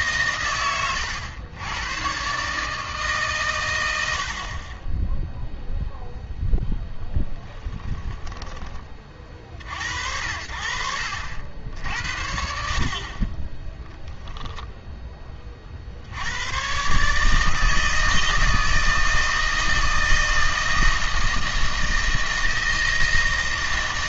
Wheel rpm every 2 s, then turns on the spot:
110, 150, 20, 0, 20, 60, 60, 10, 130, 160, 160, 160.
0-2